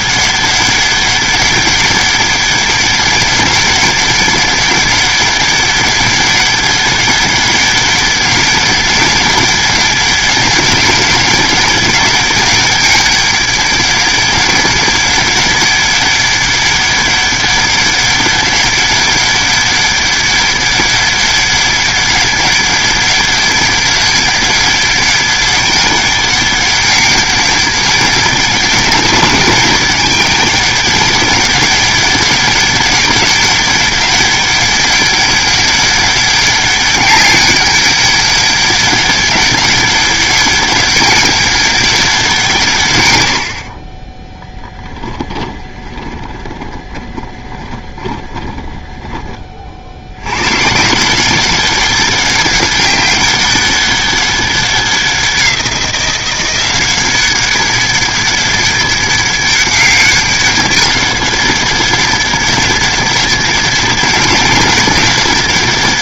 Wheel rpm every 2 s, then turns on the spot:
200, 200, 200, 200, 190, 200, 200, 200, 200, 200, 200, 200, 200, 200, 200, 200, 200, 200, 200, 200, 200, 130, 10, 20, 10, 140, 190, 190, 190, 200, 200, 200, 200.
44-50